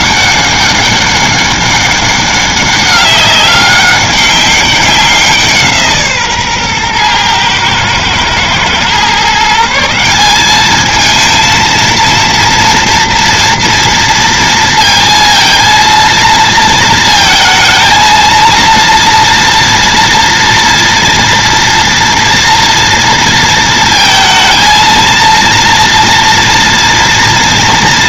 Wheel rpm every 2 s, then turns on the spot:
200, 200, 200, 130, 120, 210, 230, 230, 230, 230, 230, 230, 230, 230.
none